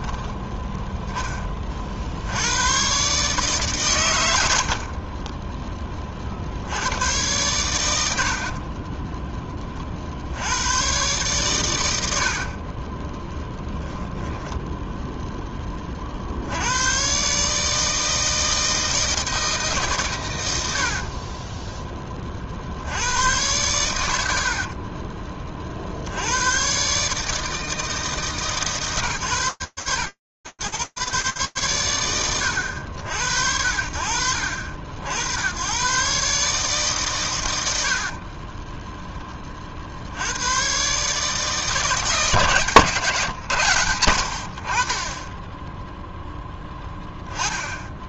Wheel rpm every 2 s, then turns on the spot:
10, 120, 60, 90, 30, 110, 30, 0, 100, 160, 70, 80, 40, 130, 140, 90, 70, 130, 50, 60, 160, 100, 0, 10.
4-6 8-10 12-14 20-22 24-26 36-38